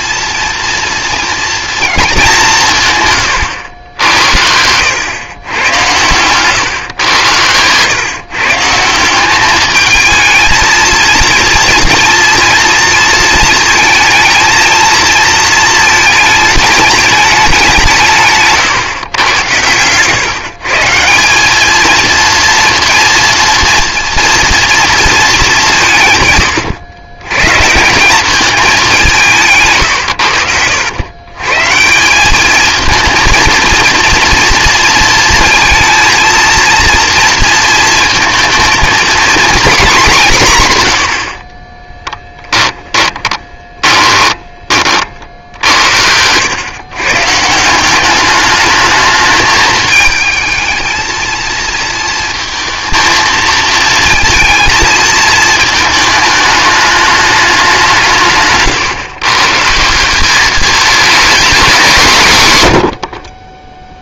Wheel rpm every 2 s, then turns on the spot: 240, 170, 90, 120, 150, 220, 230, 230, 220, 140, 150, 230, 230, 120, 200, 90, 220, 230, 230, 230, 150, 10, 30, 110, 210, 220, 230, 230, 210, 140, 210, 130.
42-44 58-60